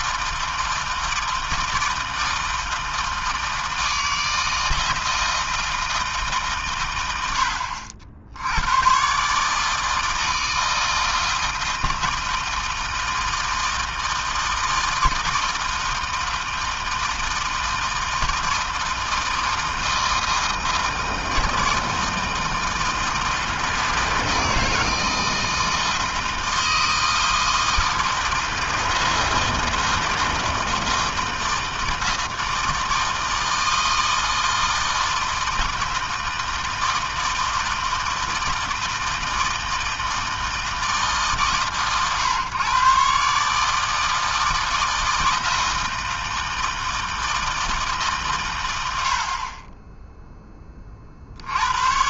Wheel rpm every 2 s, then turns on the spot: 160, 160, 160, 100, 140, 160, 160, 160, 160, 160, 160, 160, 160, 160, 170, 160, 160, 160, 160, 160, 150, 140, 160, 160, 60, 50.
none